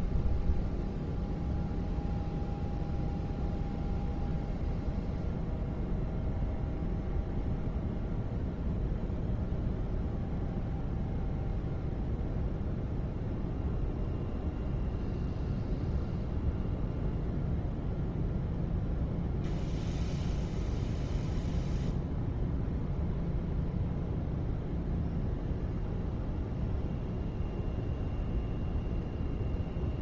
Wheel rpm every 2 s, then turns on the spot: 0, 0, 0, 0, 0, 0, 0, 0, 0, 0, 0, 0, 0, 0, 0.
none